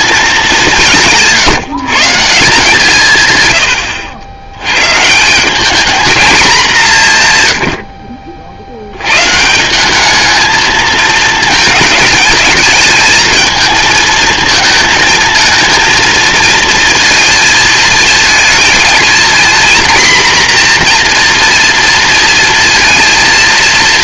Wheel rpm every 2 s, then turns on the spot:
180, 170, 130, 190, 70, 220, 220, 230, 230, 220, 240, 230.
none